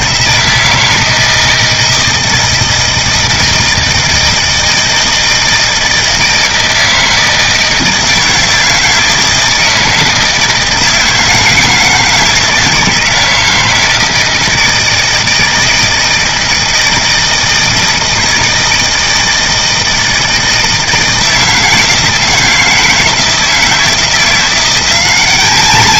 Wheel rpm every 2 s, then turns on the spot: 160, 160, 160, 160, 160, 160, 160, 160, 160, 160, 160, 160, 180.
none